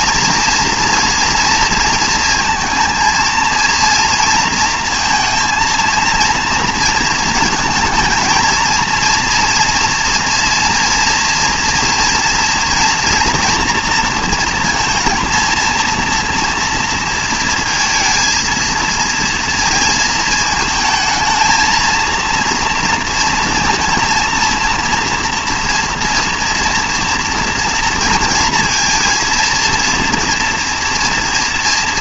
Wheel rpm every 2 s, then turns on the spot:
240, 230, 230, 230, 230, 230, 240, 230, 230, 230, 220, 230, 230, 240, 230, 240.
none